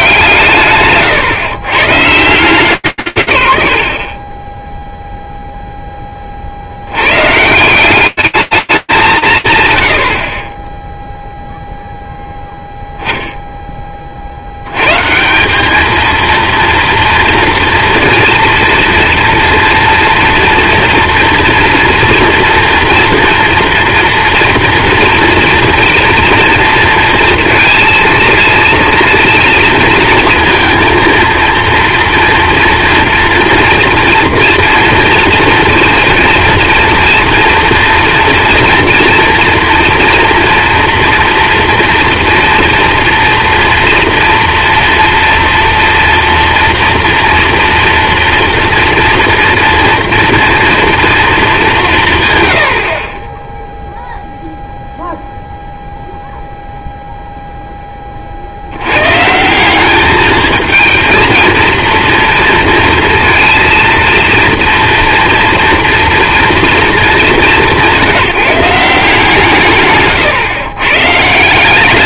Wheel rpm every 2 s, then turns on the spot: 150, 170, 30, 40, 200, 60, 10, 90, 240, 230, 230, 240, 230, 230, 230, 230, 240, 240, 240, 230, 230, 230, 230, 230, 230, 240, 90, 0, 0, 110, 220, 230, 240, 210, 170, 130.
4-6